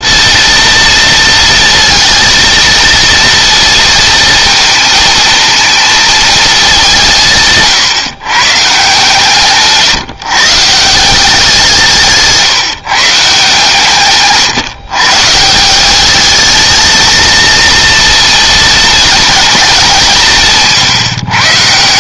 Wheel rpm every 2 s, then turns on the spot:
230, 230, 220, 180, 150, 160, 150, 130, 220, 220, 140.
none